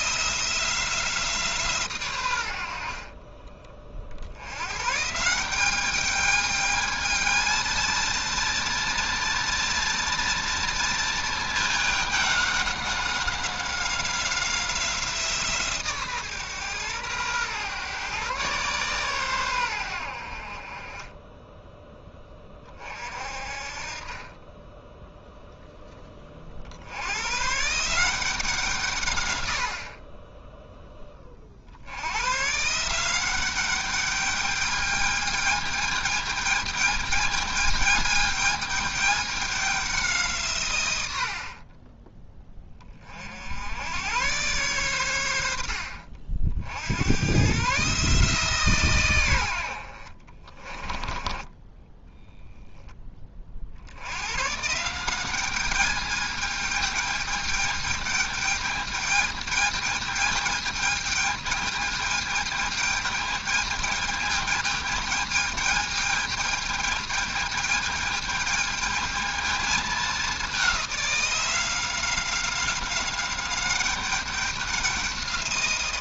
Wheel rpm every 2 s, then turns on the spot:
170, 60, 120, 220, 230, 230, 200, 180, 120, 130, 30, 30, 10, 70, 160, 10, 160, 210, 220, 210, 110, 30, 110, 70, 130, 20, 10, 160, 210, 210, 210, 210, 210, 210, 220, 190, 190, 190.
50-52